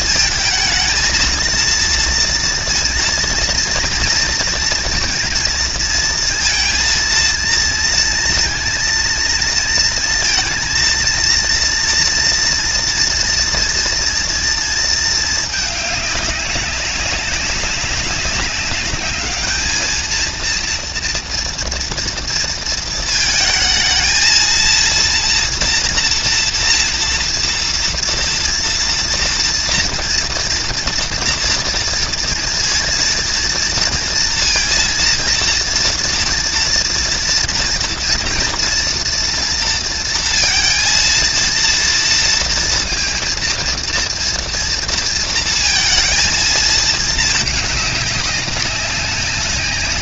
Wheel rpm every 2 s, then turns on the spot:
220, 230, 230, 230, 230, 230, 240, 230, 200, 200, 230, 230, 230, 230, 230, 230, 230, 230, 230, 230, 230, 230, 230, 220, 200.
none